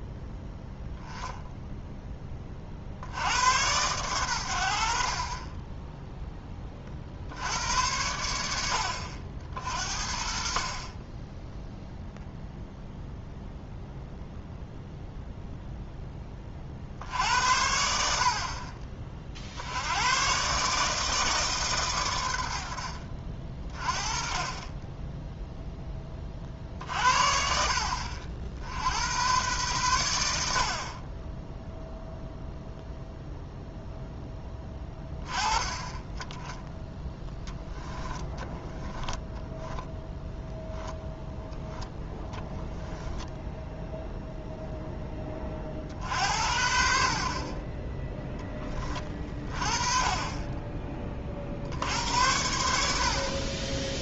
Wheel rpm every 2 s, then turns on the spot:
0, 50, 60, 30, 70, 40, 0, 0, 40, 40, 140, 70, 20, 50, 80, 50, 0, 10, 10, 10, 0, 10, 0, 60, 20, 20, 70.
38-40 42-44